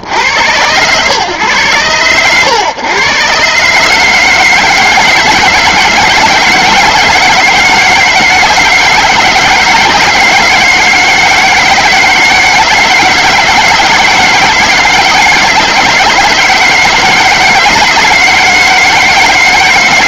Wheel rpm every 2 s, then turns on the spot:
100, 110, 160, 170, 160, 160, 160, 160, 160, 160.
none